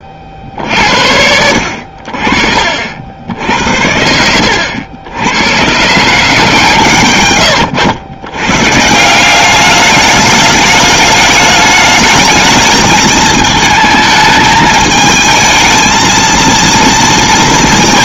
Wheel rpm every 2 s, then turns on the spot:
70, 50, 80, 130, 130, 210, 220, 220, 230.
none